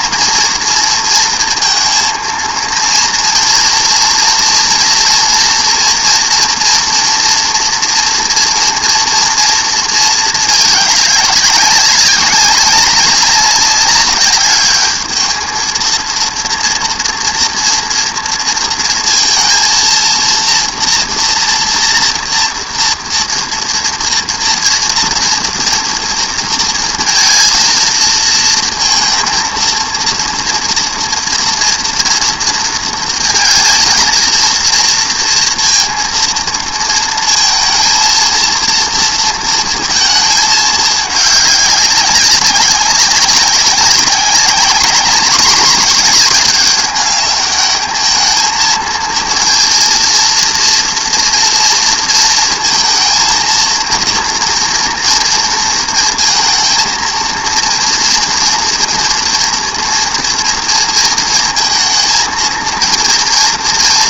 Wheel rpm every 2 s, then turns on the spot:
230, 230, 230, 230, 230, 210, 200, 210, 240, 230, 230, 230, 230, 230, 230, 230, 230, 230, 230, 230, 210, 200, 210, 210, 230, 230, 230, 230, 230, 230, 230, 230.
none